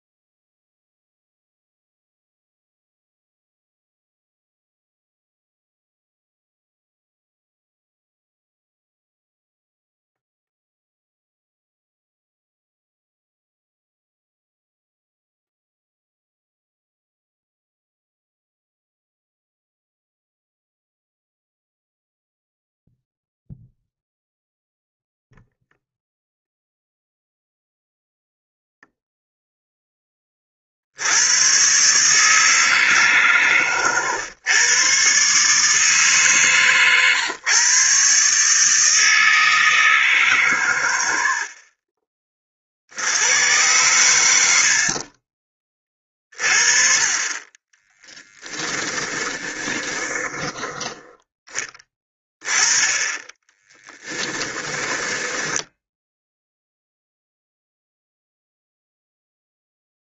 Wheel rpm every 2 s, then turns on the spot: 0, 0, 0, 0, 0, 0, 0, 0, 0, 0, 0, 0, 0, 0, 0, 50, 150, 120, 130, 150, 120, 50, 60, 40, 10, 20, 20, 20, 0, 0.
48-52 54-56